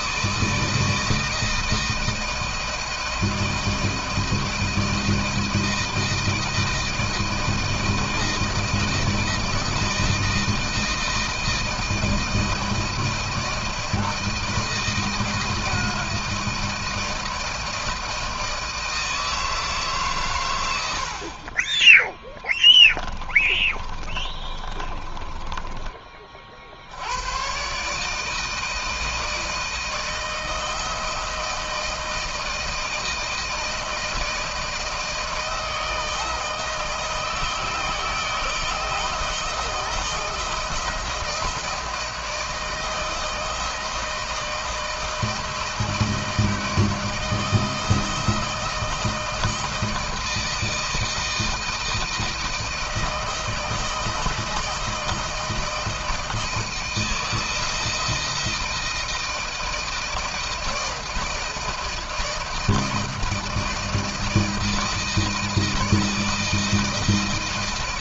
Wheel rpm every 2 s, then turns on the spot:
160, 160, 160, 160, 160, 160, 160, 160, 160, 160, 120, 10, 30, 50, 160, 160, 160, 160, 160, 160, 170, 160, 160, 160, 160, 160, 160, 160, 160, 160, 160, 160, 160, 160.
22-26